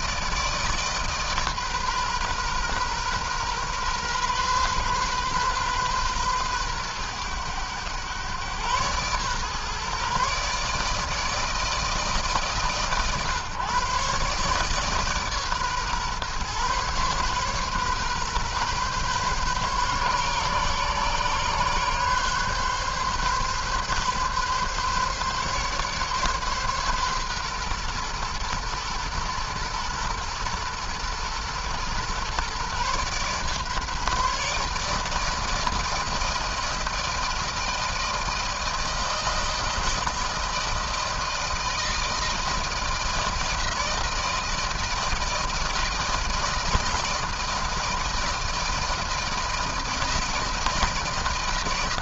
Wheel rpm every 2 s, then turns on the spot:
160, 130, 130, 120, 120, 150, 140, 140, 130, 130, 140, 140, 140, 140, 120, 120, 130, 150, 160, 160, 160, 160, 160, 160, 160, 160.
none